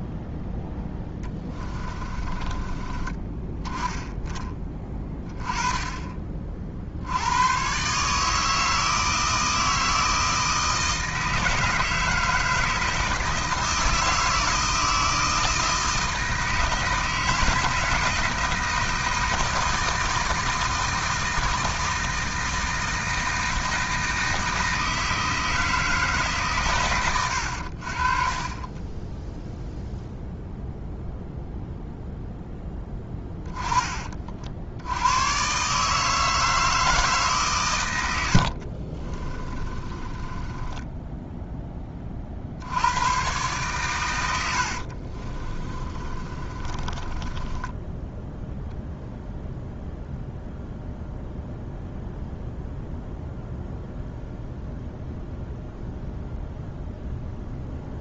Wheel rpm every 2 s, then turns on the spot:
0, 20, 20, 60, 160, 160, 160, 160, 160, 160, 160, 160, 160, 130, 30, 0, 10, 80, 160, 60, 10, 80, 60, 30, 0, 0, 0, 0, 0.
2-4 28-30 32-34 38-42 44-48